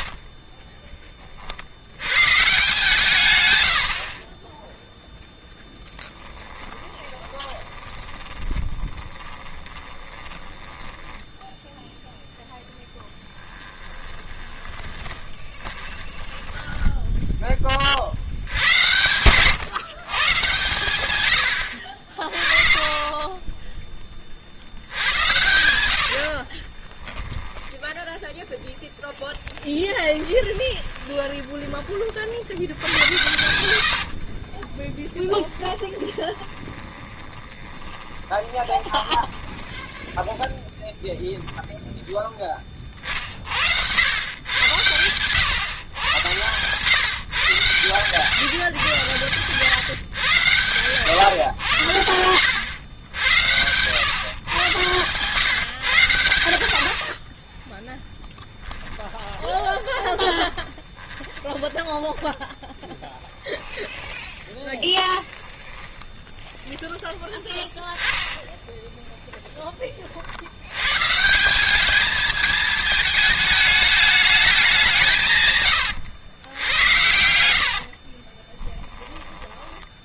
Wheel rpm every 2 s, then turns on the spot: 30, 150, 10, 20, 10, 10, 0, 20, 10, 90, 130, 30, 70, 20, 0, 20, 90, 30, 20, 10, 0, 30, 120, 130, 130, 110, 90, 130, 80, 10, 20, 10, 10, 10, 10, 100, 220, 170, 80, 10.
0-2 6-12 14-16 26-28 30-40 58-64 68-70 76-78